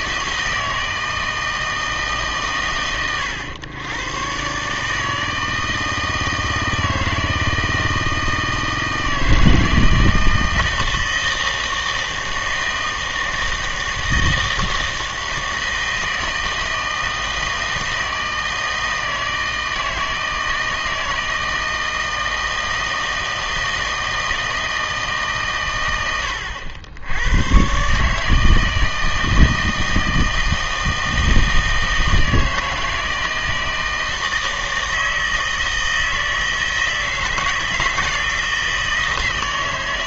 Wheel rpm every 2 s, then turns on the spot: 160, 120, 140, 160, 160, 160, 160, 160, 160, 160, 160, 160, 160, 80, 160, 160, 160, 160, 160, 160.
none